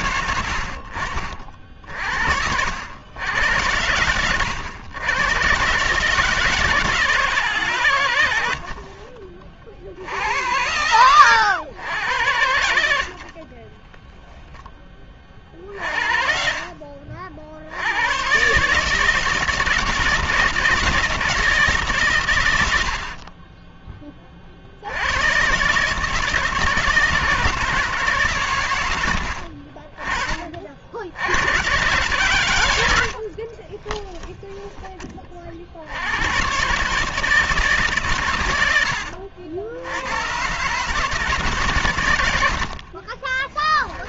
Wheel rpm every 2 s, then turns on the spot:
70, 100, 110, 150, 50, 120, 40, 50, 70, 160, 160, 10, 130, 160, 50, 90, 50, 30, 150, 70, 150, 20.
8-10 12-14 32-34 42-44